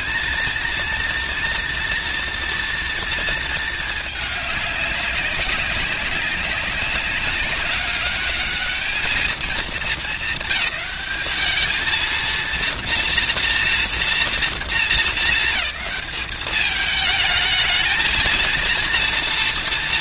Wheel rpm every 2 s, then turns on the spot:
230, 230, 210, 190, 210, 220, 230, 230, 210, 230.
none